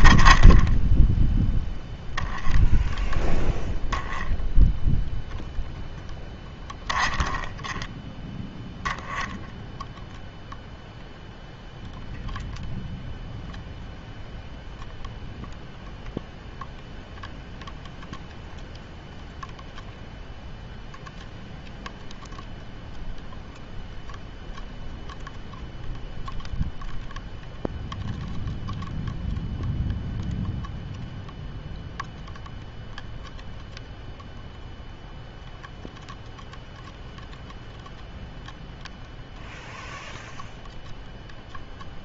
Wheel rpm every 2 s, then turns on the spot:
10, 0, 0, 10, 0, 0, 0, 0, 0, 0, 0, 0, 0, 0, 0, 0, 0, 0, 0, 0, 0.
none